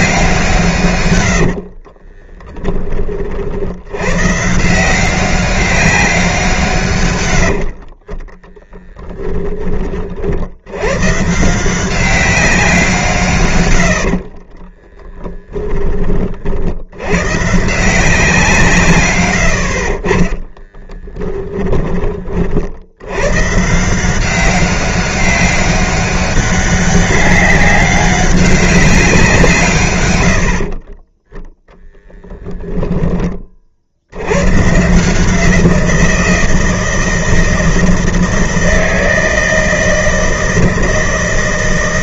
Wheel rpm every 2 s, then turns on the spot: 150, 20, 150, 150, 10, 90, 180, 20, 60, 160, 10, 60, 190, 200, 200, 50, 20, 130, 160, 160, 160.
8-10 14-16 20-22 32-34